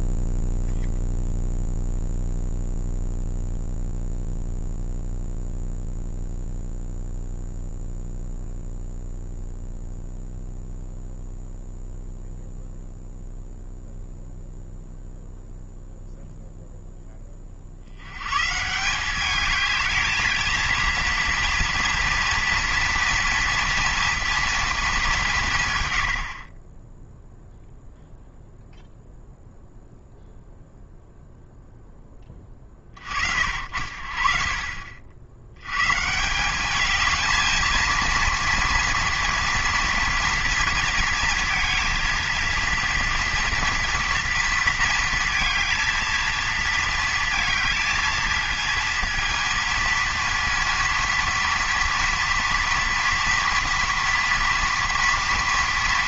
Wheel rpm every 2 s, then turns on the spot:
0, 0, 0, 0, 0, 0, 0, 0, 0, 140, 230, 230, 230, 30, 0, 0, 20, 50, 200, 230, 230, 230, 230, 230, 230, 230, 230, 230.
none